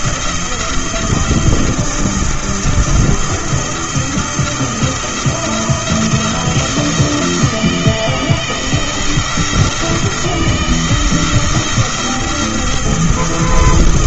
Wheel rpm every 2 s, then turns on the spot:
170, 170, 170, 170, 170, 160, 170.
none